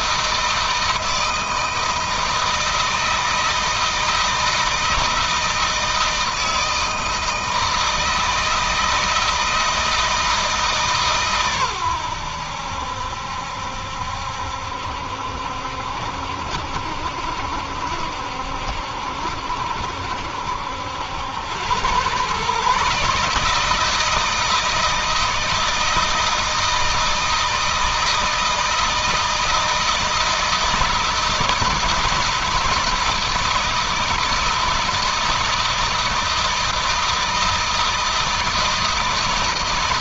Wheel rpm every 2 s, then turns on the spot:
160, 160, 160, 160, 160, 150, 80, 70, 70, 70, 70, 130, 160, 160, 160, 160, 160, 160, 160, 160.
none